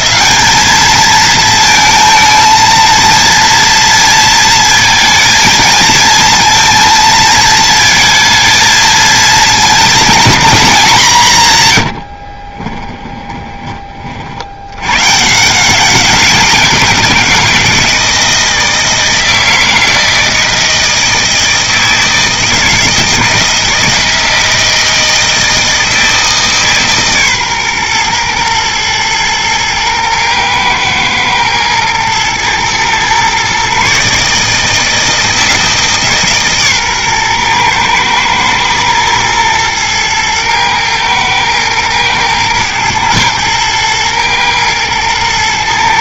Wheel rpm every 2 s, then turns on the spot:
220, 230, 230, 230, 230, 190, 20, 130, 170, 160, 160, 160, 160, 140, 110, 110, 120, 160, 130, 110, 110, 120, 110.
12-14